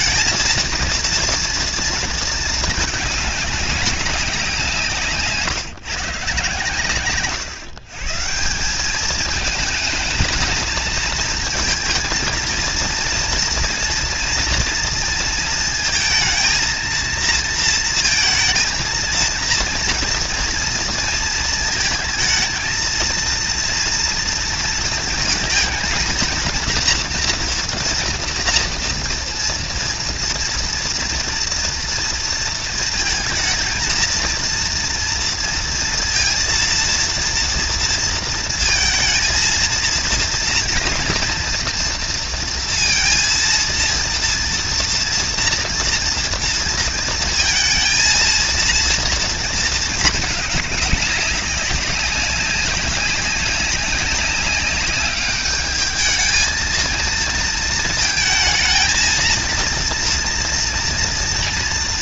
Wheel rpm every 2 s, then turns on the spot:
230, 220, 170, 130, 190, 220, 230, 230, 230, 230, 230, 220, 230, 240, 230, 230, 230, 230, 230, 230, 240, 230, 230, 230, 230, 210, 190, 200, 220, 220, 230.
none